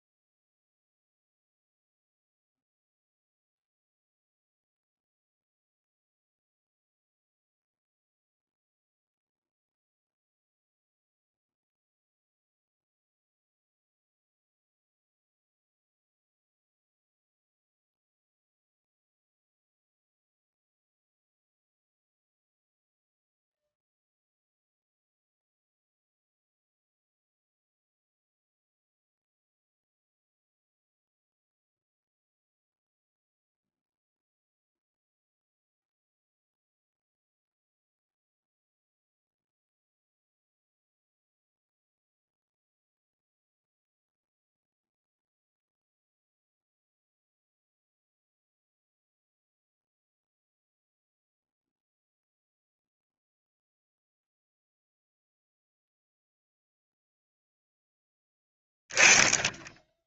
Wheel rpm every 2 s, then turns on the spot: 0, 0, 0, 0, 0, 0, 0, 0, 0, 0, 0, 0, 0, 0, 0, 0, 0, 0, 0, 0, 0, 0, 0, 0, 0, 0, 0, 0, 0, 10.
none